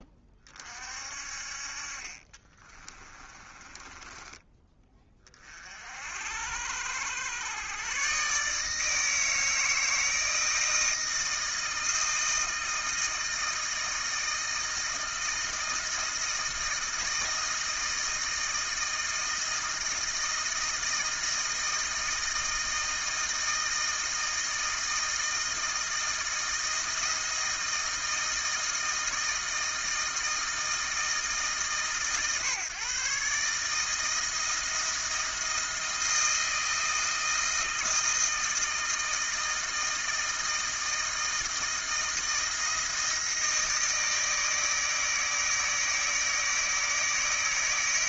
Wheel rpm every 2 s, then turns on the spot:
50, 20, 20, 90, 160, 160, 160, 160, 160, 160, 160, 160, 160, 160, 160, 150, 140, 170, 160, 160, 160, 160, 160, 160.
2-4